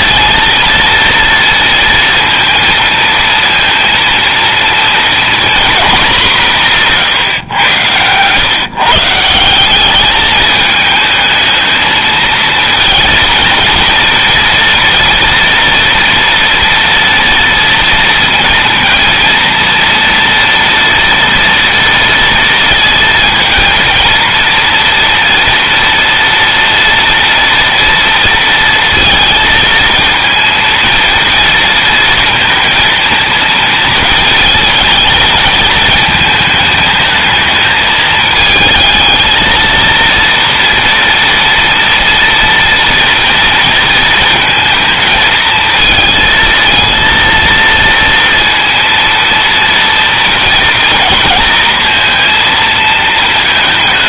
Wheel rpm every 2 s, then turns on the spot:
230, 230, 230, 160, 140, 220, 230, 230, 230, 230, 230, 230, 230, 230, 230, 230, 230, 220, 220, 220, 230, 230, 230, 230, 230, 240, 220.
6-8